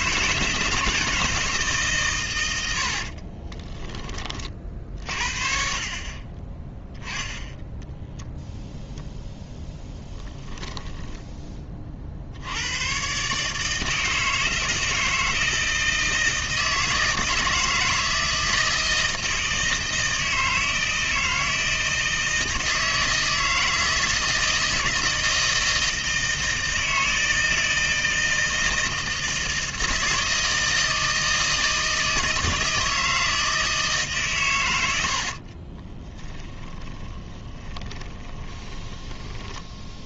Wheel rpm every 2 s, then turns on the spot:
160, 80, 40, 20, 0, 10, 90, 160, 160, 160, 160, 160, 160, 160, 160, 160, 160, 120, 20, 20.
10-12 36-40